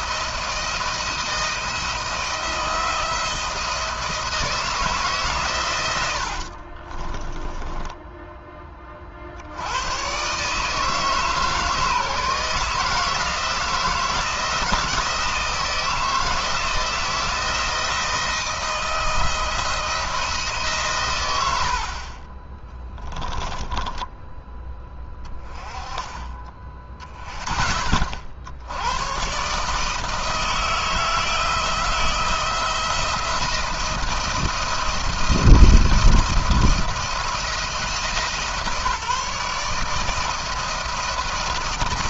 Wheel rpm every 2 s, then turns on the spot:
160, 170, 160, 40, 40, 150, 160, 170, 160, 160, 130, 10, 10, 30, 90, 160, 170, 170, 170, 160, 160.
6-8 22-24